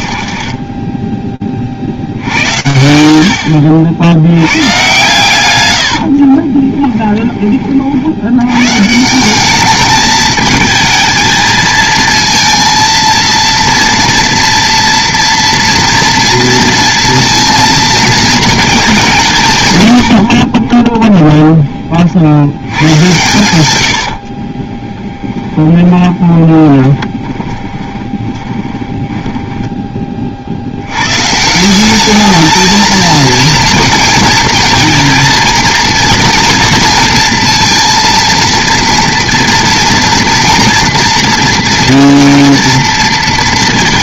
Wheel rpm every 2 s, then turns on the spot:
20, 10, 70, 120, 10, 160, 220, 230, 230, 230, 180, 0, 100, 20, 30, 10, 170, 220, 230, 230, 230, 230.
26-32